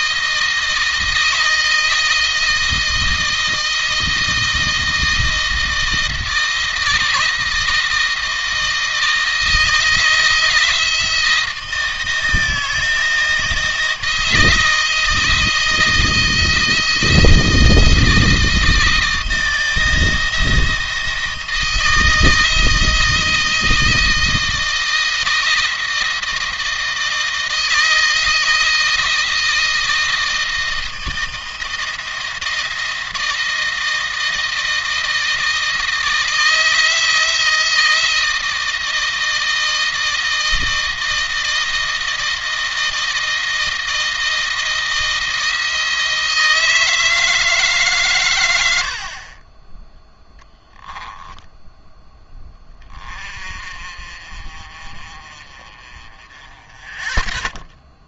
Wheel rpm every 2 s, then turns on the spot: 160, 160, 160, 160, 160, 160, 160, 160, 160, 160, 170, 160, 160, 160, 160, 160, 160, 160, 160, 160, 160, 170, 170, 160, 90, 10, 20, 40, 20.
50-52